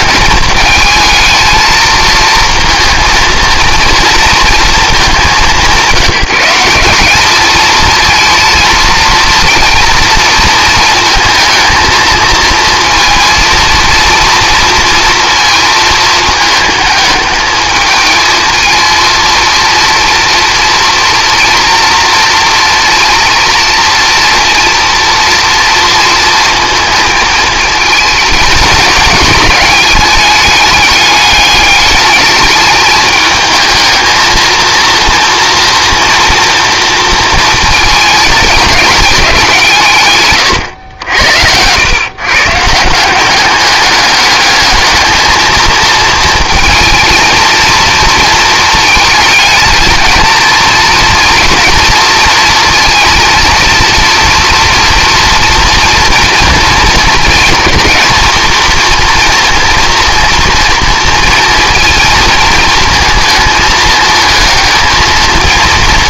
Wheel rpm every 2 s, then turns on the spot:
220, 230, 220, 190, 230, 220, 230, 230, 220, 230, 230, 230, 230, 220, 210, 210, 210, 230, 230, 210, 110, 160, 220, 230, 220, 220, 230, 240, 220, 230, 230, 220, 220.
none